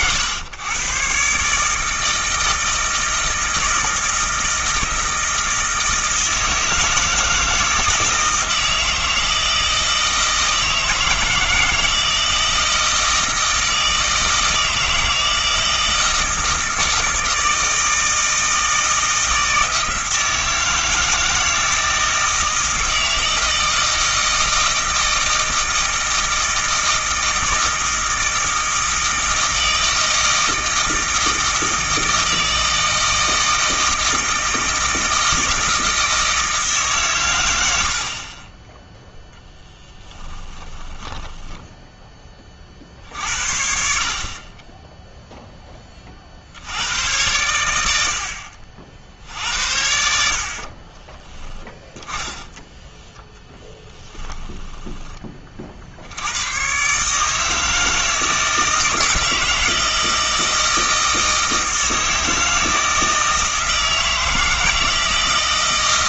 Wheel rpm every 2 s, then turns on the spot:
120, 160, 160, 160, 160, 160, 160, 160, 160, 160, 160, 160, 160, 160, 160, 160, 160, 160, 140, 10, 20, 40, 20, 90, 60, 40, 10, 10, 120, 160, 160, 160, 160.
40-42 44-46 50-56